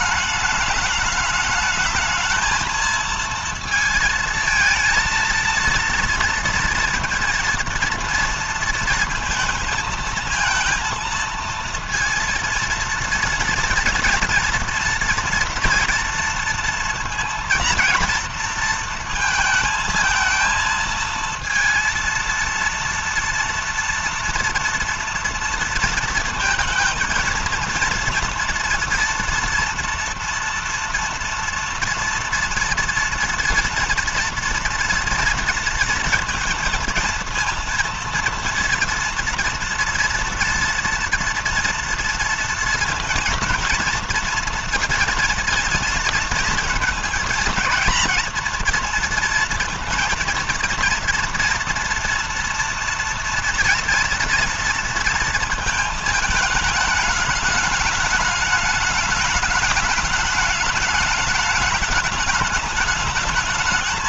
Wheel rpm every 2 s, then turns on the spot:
210, 220, 220, 230, 230, 230, 230, 230, 230, 230, 230, 230, 230, 230, 230, 230, 230, 230, 230, 230, 230, 230, 230, 220, 230, 240, 230, 230, 210, 210, 210, 210.
none